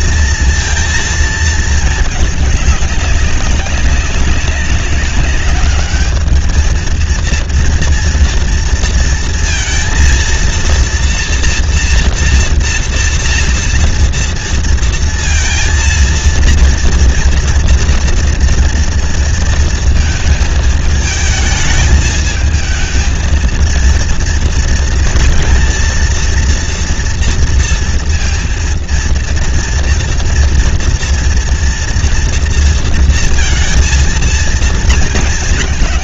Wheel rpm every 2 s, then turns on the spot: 230, 210, 200, 220, 230, 230, 240, 230, 230, 230, 220, 220, 230, 230, 230, 240, 230, 230.
none